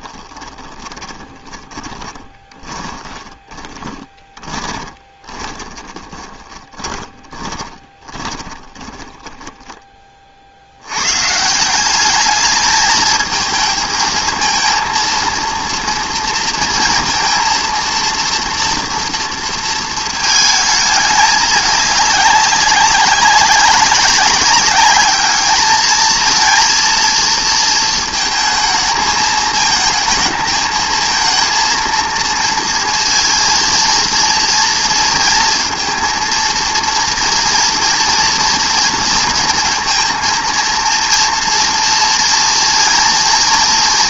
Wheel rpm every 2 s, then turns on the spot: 30, 20, 20, 20, 20, 110, 220, 230, 230, 230, 210, 190, 210, 230, 220, 220, 230, 230, 230, 230, 230, 230.
0-10